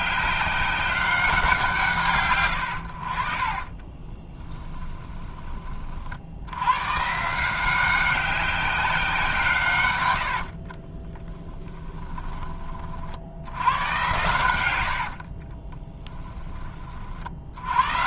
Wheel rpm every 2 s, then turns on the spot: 190, 100, 20, 110, 190, 60, 30, 90, 20.
4-6 10-12 14-16